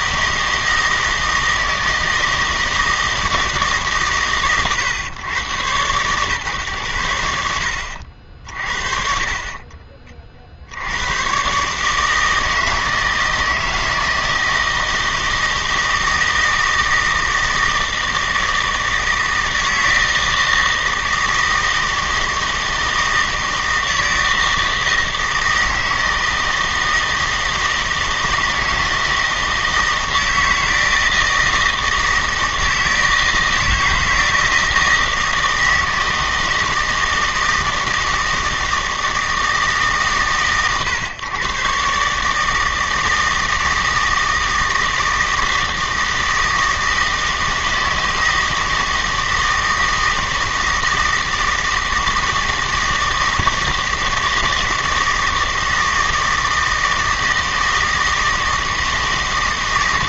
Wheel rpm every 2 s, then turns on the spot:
160, 160, 120, 110, 50, 60, 160, 160, 160, 160, 160, 160, 160, 160, 160, 160, 160, 160, 160, 160, 120, 160, 160, 160, 160, 160, 160, 160, 160, 160.
none